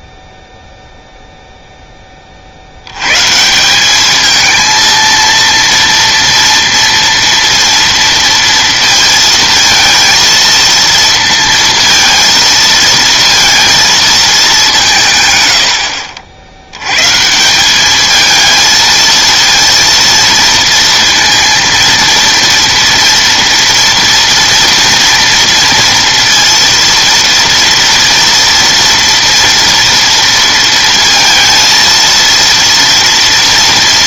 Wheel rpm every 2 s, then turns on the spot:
0, 80, 220, 230, 230, 230, 230, 180, 100, 220, 230, 230, 230, 230, 230, 230, 230.
none